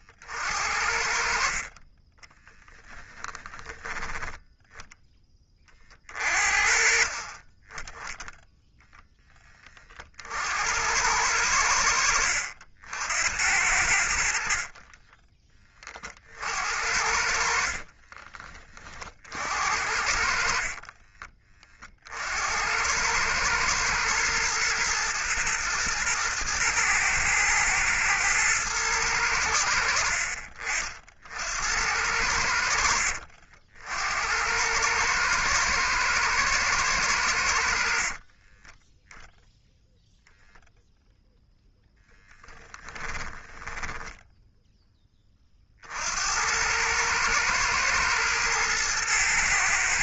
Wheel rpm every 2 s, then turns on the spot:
50, 10, 10, 40, 0, 80, 80, 20, 60, 40, 30, 90, 110, 120, 110, 50, 70, 100, 100, 10, 0, 10, 10, 100, 110.
2-4 20-22 42-44